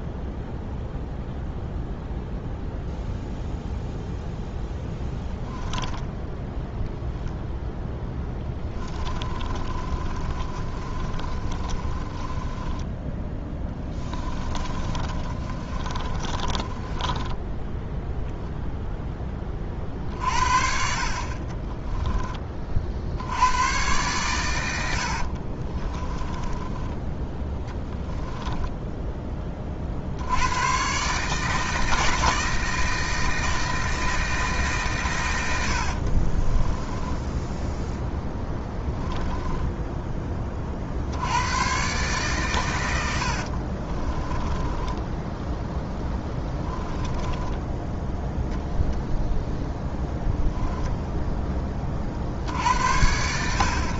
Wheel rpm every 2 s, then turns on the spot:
0, 0, 10, 0, 20, 30, 10, 30, 20, 0, 50, 50, 80, 10, 10, 130, 160, 140, 10, 10, 60, 100, 10, 10, 0, 0, 80.
4-6 8-18 24-28 36-40 42-48